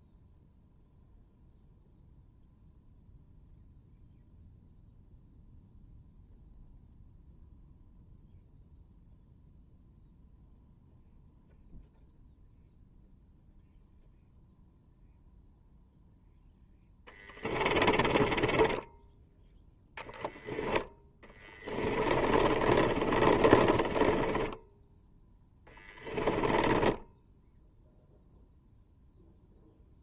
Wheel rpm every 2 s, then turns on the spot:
0, 0, 0, 0, 0, 0, 0, 0, 10, 20, 10, 30, 10, 10, 0.
16-20 22-28